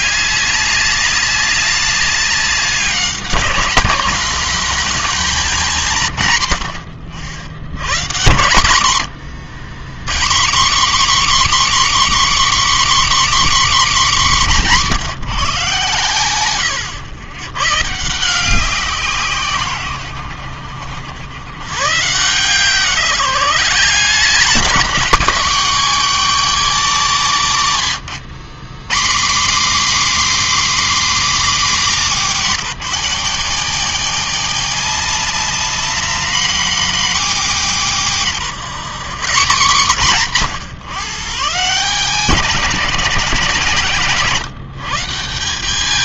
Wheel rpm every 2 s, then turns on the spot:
200, 200, 230, 90, 100, 230, 280, 190, 120, 180, 80, 160, 220, 250, 160, 290, 200, 200, 240, 180, 150, 190, 150.
none